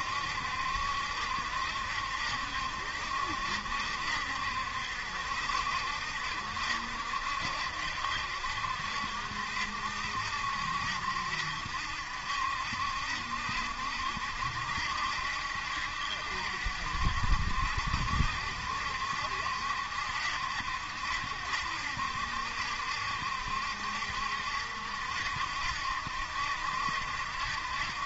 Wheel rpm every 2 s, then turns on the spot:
70, 70, 70, 70, 70, 70, 70, 70, 70, 70, 70, 70, 70, 70.
none